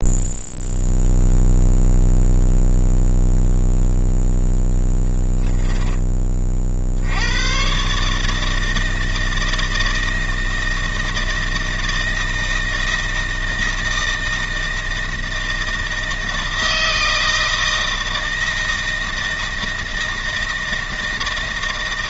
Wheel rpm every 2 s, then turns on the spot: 0, 0, 10, 60, 160, 160, 160, 160, 160, 160, 160.
4-6